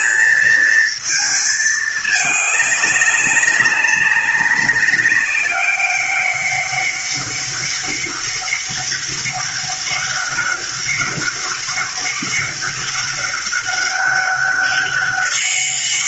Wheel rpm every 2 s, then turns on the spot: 220, 200, 190, 200, 200, 200, 200, 200.
none